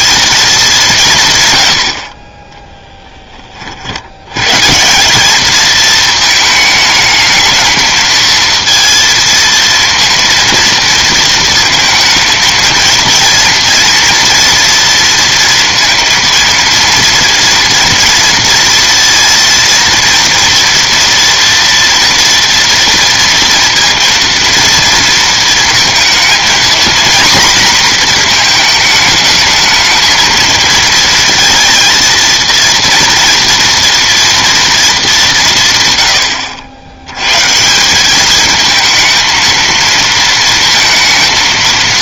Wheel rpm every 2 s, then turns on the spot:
130, 30, 190, 220, 230, 230, 230, 230, 230, 230, 230, 230, 230, 240, 210, 220, 230, 200, 100, 230, 220.
2-4